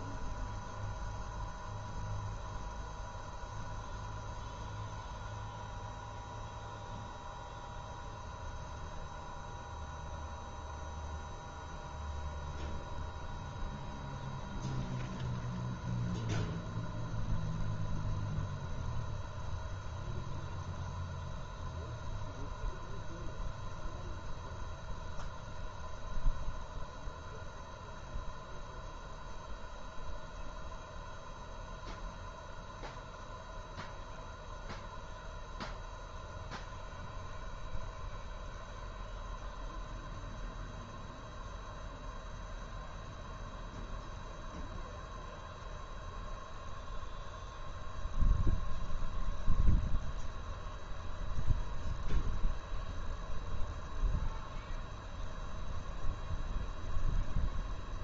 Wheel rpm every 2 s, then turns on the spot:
0, 0, 0, 0, 0, 0, 0, 0, 0, 0, 0, 0, 0, 0, 0, 0, 0, 0, 0, 0, 0, 0, 0, 0, 0, 0, 0, 0, 0.
none